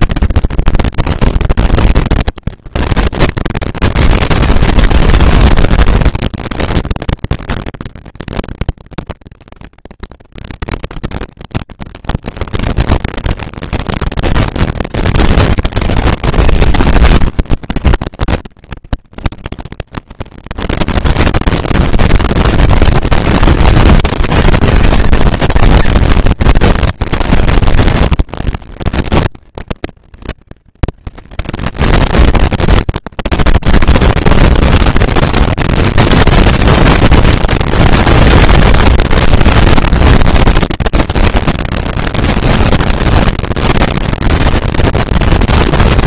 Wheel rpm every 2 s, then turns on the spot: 230, 230, 230, 230, 230, 230, 230, 230, 220, 200, 200, 210, 220, 230, 230, 220, 230, 230, 230, 230, 230, 230, 230.
none